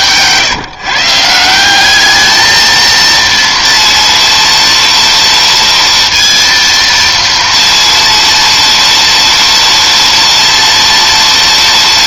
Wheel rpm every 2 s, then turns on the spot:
140, 220, 230, 230, 230, 230.
none